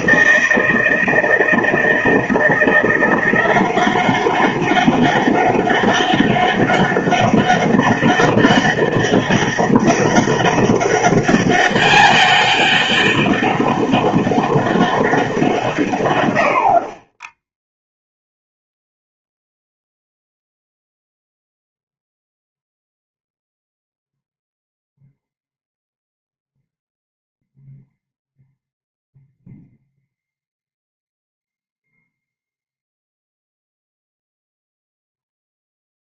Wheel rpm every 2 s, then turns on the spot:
170, 170, 190, 200, 200, 200, 200, 200, 70, 0, 0, 0, 0, 0, 0, 0, 0, 0.
none